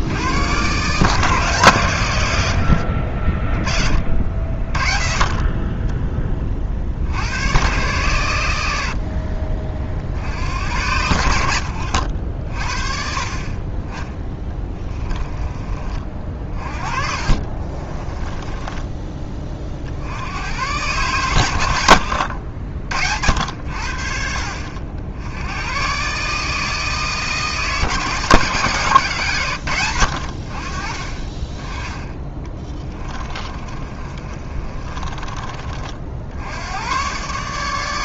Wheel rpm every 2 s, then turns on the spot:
140, 60, 40, 60, 70, 90, 40, 20, 40, 20, 120, 70, 70, 160, 140, 40, 20, 30, 110.
16-20 32-36